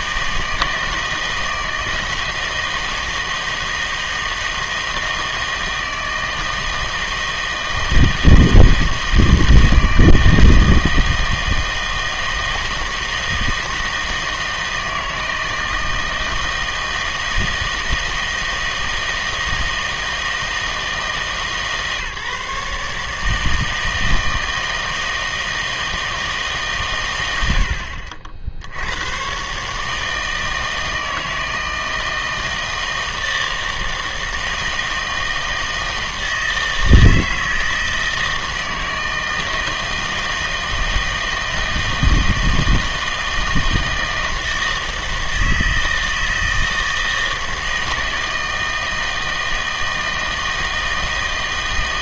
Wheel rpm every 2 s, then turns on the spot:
160, 160, 160, 160, 160, 160, 160, 160, 160, 160, 160, 150, 160, 150, 70, 160, 160, 160, 160, 160, 160, 160, 160, 160, 160, 160.
none